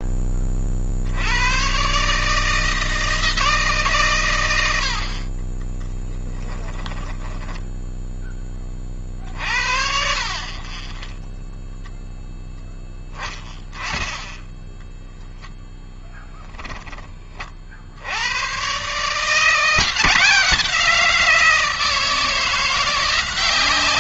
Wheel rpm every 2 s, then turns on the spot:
70, 160, 70, 20, 30, 10, 10, 0, 20, 150, 170, 180.
4-8